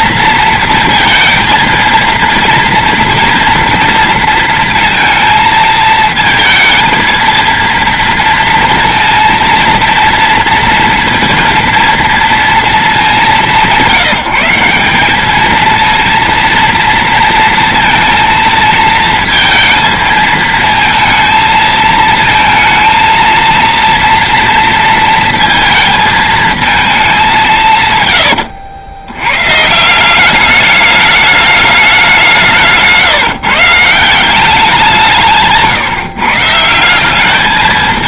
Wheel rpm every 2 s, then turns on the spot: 230, 230, 230, 220, 230, 230, 230, 170, 230, 230, 220, 230, 230, 220, 80, 210, 170, 190, 160.
none